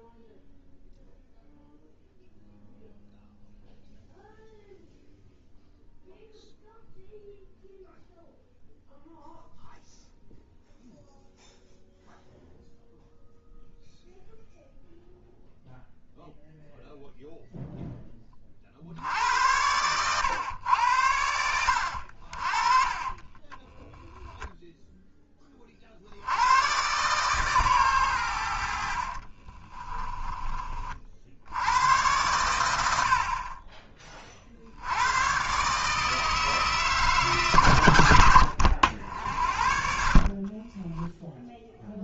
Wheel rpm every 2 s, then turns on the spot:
0, 0, 0, 0, 0, 0, 0, 0, 0, 50, 100, 40, 10, 120, 60, 40, 90, 80, 160, 90, 20.
40-42